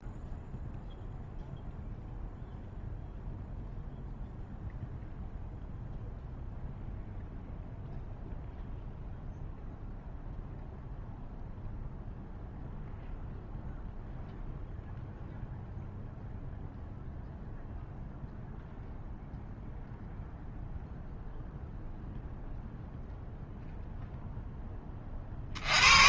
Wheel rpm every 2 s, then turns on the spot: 0, 0, 0, 0, 0, 0, 0, 0, 0, 0, 0, 0, 10.
none